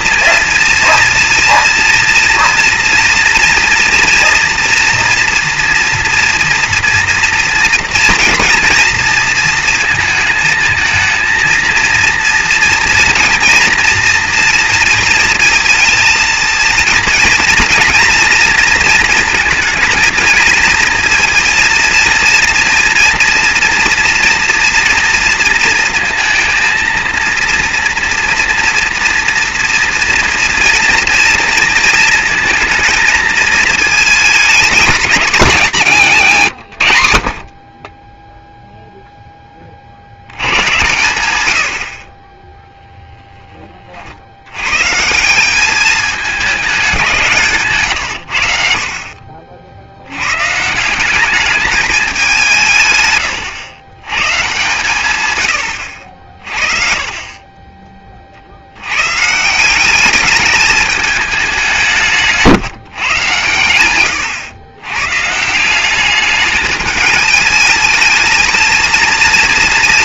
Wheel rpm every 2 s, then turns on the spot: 230, 230, 230, 230, 230, 220, 230, 230, 230, 230, 230, 230, 240, 230, 230, 230, 220, 210, 110, 0, 110, 0, 150, 180, 50, 190, 120, 120, 30, 130, 210, 130, 130, 210, 230.
none